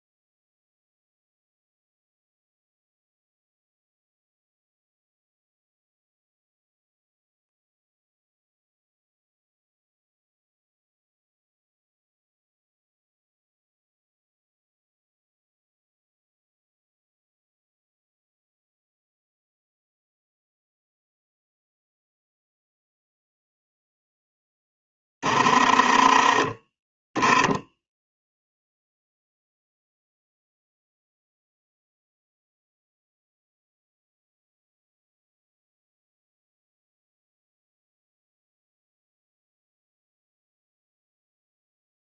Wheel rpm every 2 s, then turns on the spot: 0, 0, 0, 0, 0, 0, 0, 0, 0, 0, 0, 0, 10, 10, 0, 0, 0, 0, 0, 0, 0.
none